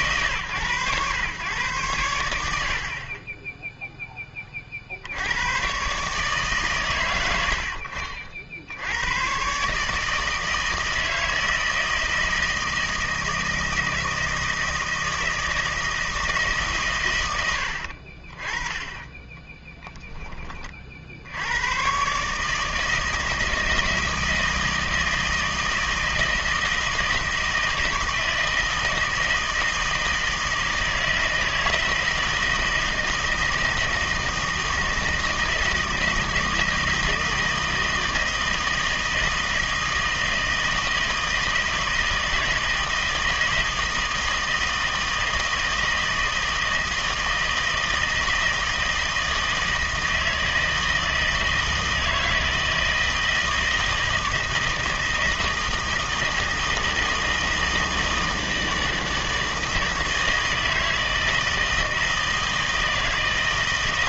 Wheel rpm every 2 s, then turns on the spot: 120, 60, 50, 130, 80, 160, 160, 160, 140, 20, 40, 160, 160, 160, 160, 160, 160, 160, 160, 160, 160, 160, 160, 160, 160, 160, 160, 160, 160, 160, 160, 160.
none